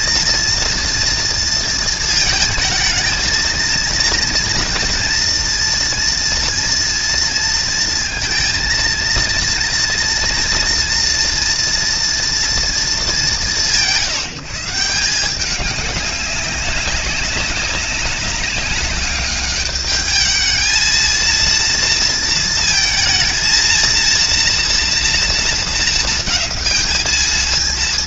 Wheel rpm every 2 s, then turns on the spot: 230, 220, 230, 240, 230, 230, 240, 170, 200, 200, 220, 230, 230, 230.
none